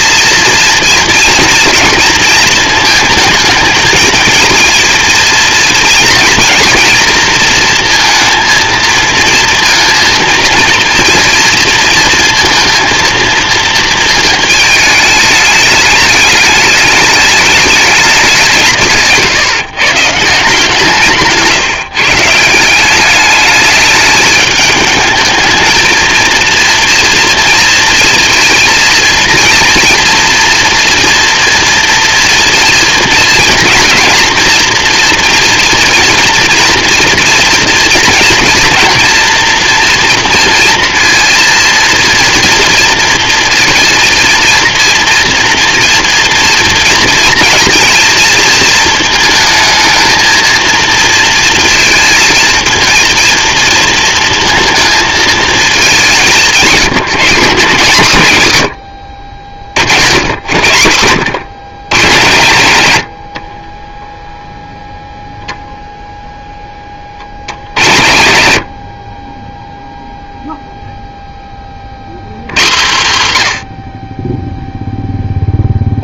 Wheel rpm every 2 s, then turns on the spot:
240, 220, 230, 230, 230, 230, 230, 210, 210, 160, 160, 170, 210, 230, 230, 230, 230, 230, 240, 230, 230, 230, 230, 230, 230, 230, 220, 230, 160, 90, 80, 100, 0, 10, 70, 0, 140, 0.
none